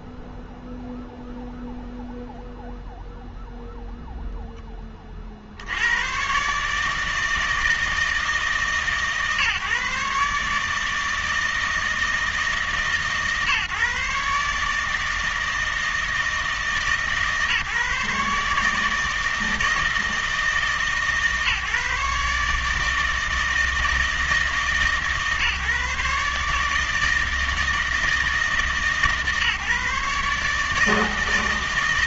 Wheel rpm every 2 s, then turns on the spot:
0, 0, 10, 140, 150, 150, 150, 150, 150, 150, 150, 150, 150, 150, 160, 150.
none